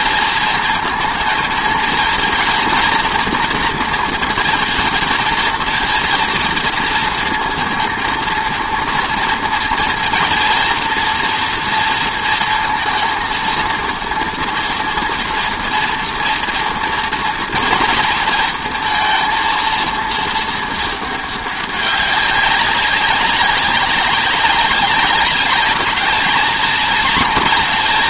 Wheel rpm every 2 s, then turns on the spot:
230, 230, 230, 230, 230, 230, 230, 230, 230, 230, 220, 200, 200, 220.
none